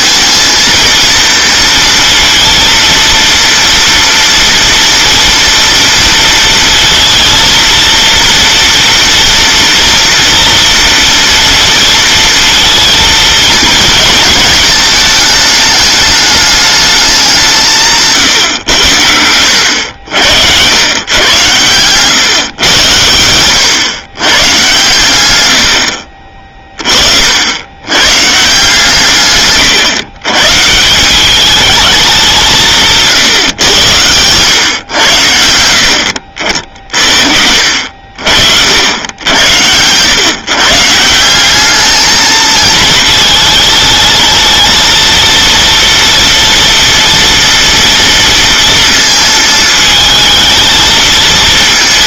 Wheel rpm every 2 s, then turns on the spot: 230, 230, 230, 230, 230, 230, 230, 220, 210, 130, 90, 120, 120, 40, 140, 130, 180, 110, 50, 60, 130, 220, 220, 230, 230, 220.
none